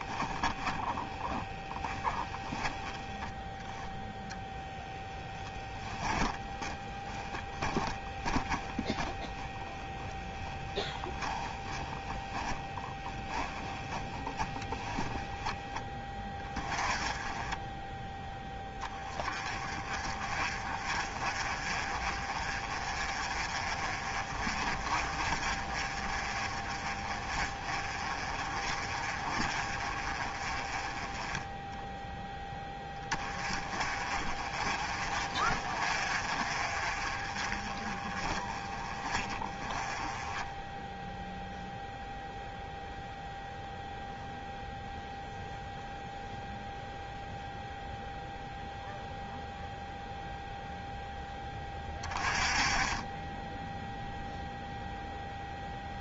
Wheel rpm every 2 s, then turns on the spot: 20, 10, 10, 10, 20, 10, 10, 10, 20, 20, 40, 30, 40, 30, 30, 20, 10, 30, 40, 20, 10, 0, 0, 0, 0, 0, 20, 0.
0-2 6-14